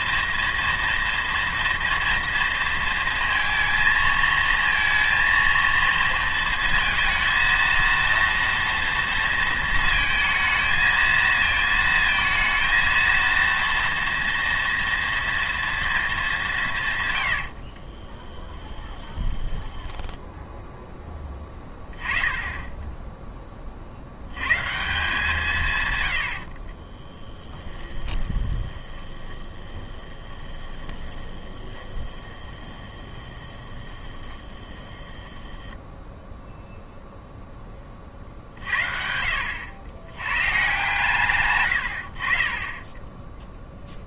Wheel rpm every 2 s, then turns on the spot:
230, 230, 230, 230, 230, 220, 230, 230, 120, 10, 10, 10, 140, 30, 20, 20, 20, 20, 0, 60, 130, 20.
18-20 26-36